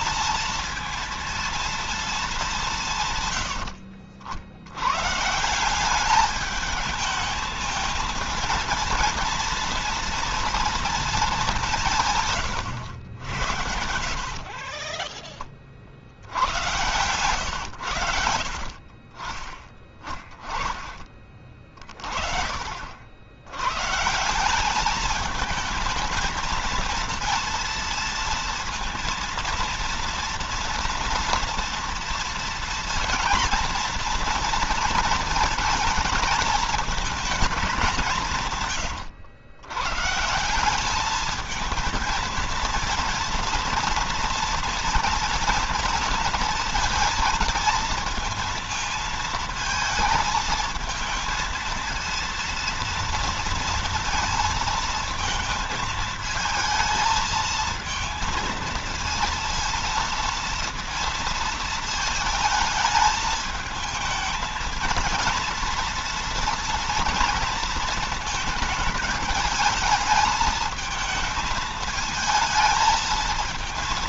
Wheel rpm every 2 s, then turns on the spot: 230, 140, 140, 210, 230, 220, 90, 10, 100, 30, 20, 70, 210, 230, 230, 240, 230, 230, 220, 120, 210, 230, 240, 230, 220, 220, 230, 220, 220, 230, 230, 220, 230, 230, 220, 220, 220.
12-14